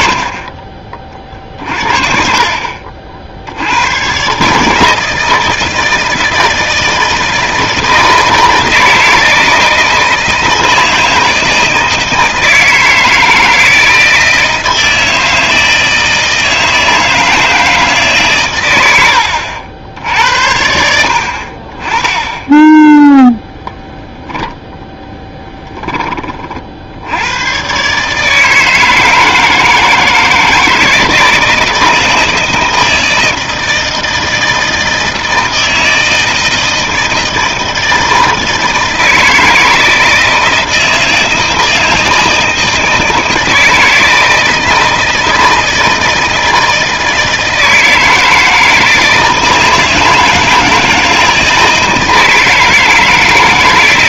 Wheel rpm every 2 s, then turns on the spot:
40, 40, 150, 160, 160, 160, 160, 160, 160, 100, 80, 10, 10, 60, 160, 160, 160, 160, 160, 160, 160, 160, 160, 160, 160, 160, 160.
none